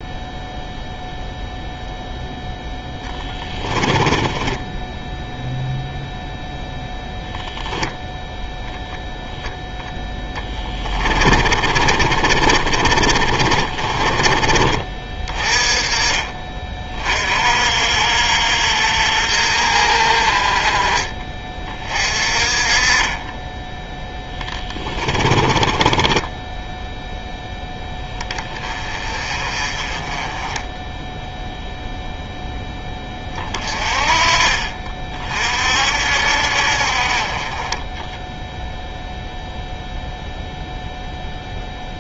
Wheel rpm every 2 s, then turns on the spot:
0, 10, 0, 0, 0, 20, 30, 30, 40, 60, 30, 30, 20, 10, 30, 10, 10, 40, 50, 0, 0.
2-4 10-14 20-22 24-26 30-32